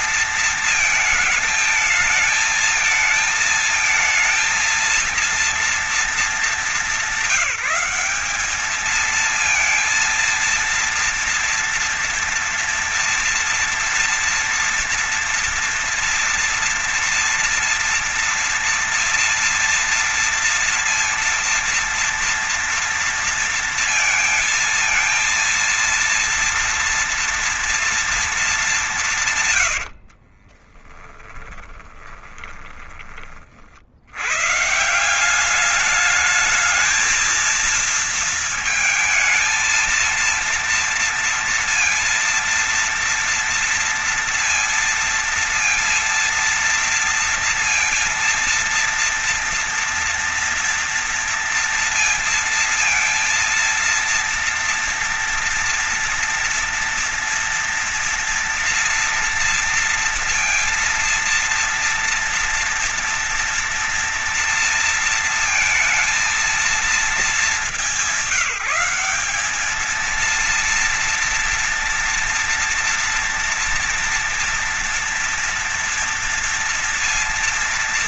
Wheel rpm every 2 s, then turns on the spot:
220, 220, 230, 200, 220, 230, 230, 230, 230, 240, 240, 230, 230, 230, 190, 30, 30, 160, 220, 220, 230, 230, 230, 230, 230, 230, 230, 230, 230, 230, 230, 230, 230, 220, 200, 230, 240, 230, 230.
30-32